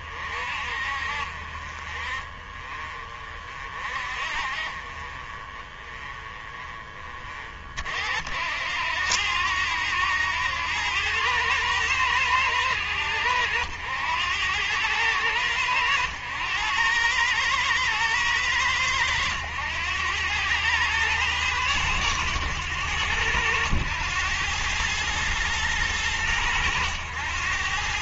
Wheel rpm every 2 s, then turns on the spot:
50, 40, 40, 30, 80, 100, 100, 100, 100, 100, 110, 100, 110, 100.
none